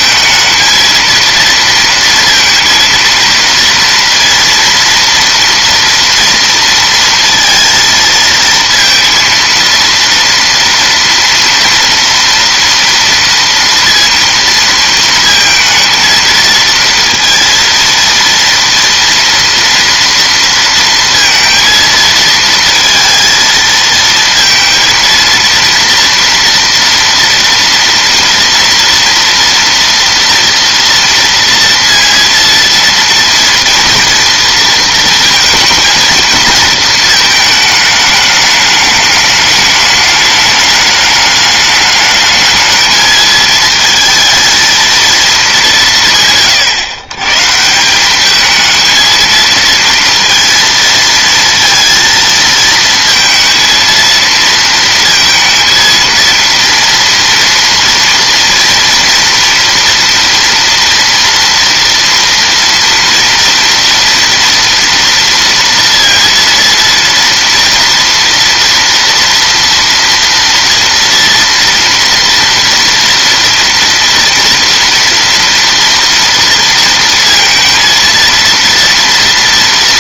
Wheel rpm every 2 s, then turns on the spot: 230, 230, 230, 230, 230, 230, 230, 230, 230, 230, 230, 230, 230, 230, 230, 230, 230, 230, 220, 210, 210, 220, 230, 130, 220, 230, 230, 230, 230, 230, 230, 230, 230, 230, 230, 230, 230, 240, 230, 230.
none